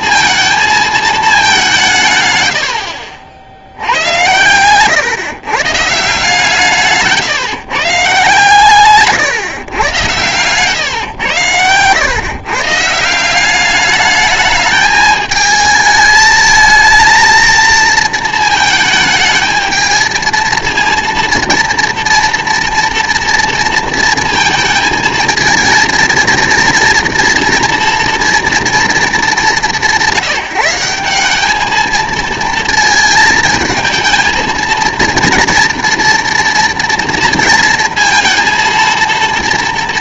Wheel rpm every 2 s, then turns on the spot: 220, 90, 120, 150, 140, 140, 150, 220, 220, 220, 230, 230, 230, 230, 230, 180, 230, 230, 230, 230.
none